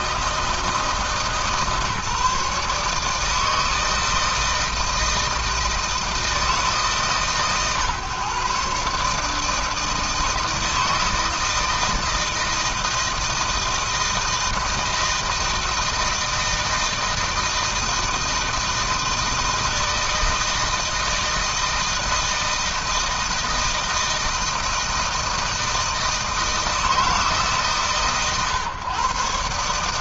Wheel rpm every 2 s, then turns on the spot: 160, 160, 160, 150, 150, 160, 160, 160, 160, 160, 160, 160, 160, 150, 140.
none